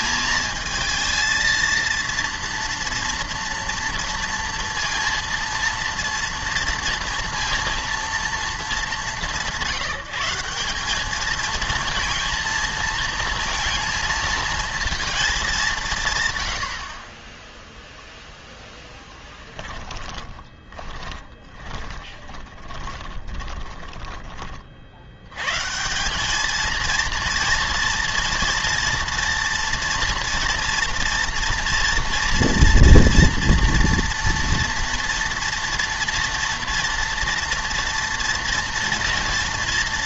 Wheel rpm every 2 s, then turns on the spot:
230, 230, 230, 230, 200, 190, 230, 230, 80, 0, 20, 20, 40, 220, 230, 230, 230, 230, 230, 240.
20-24